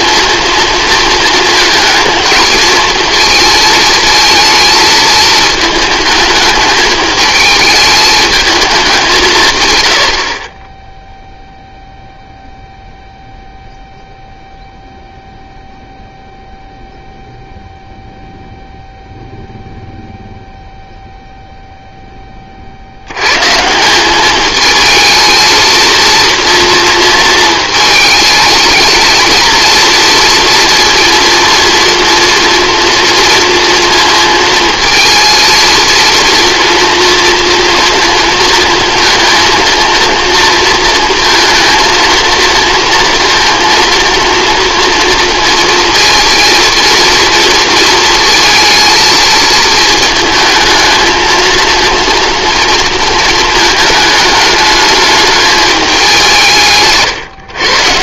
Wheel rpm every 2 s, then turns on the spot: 230, 220, 220, 210, 100, 0, 0, 0, 0, 0, 0, 60, 220, 230, 220, 230, 230, 230, 230, 230, 230, 230, 240, 230, 230, 220, 230, 220, 150.
none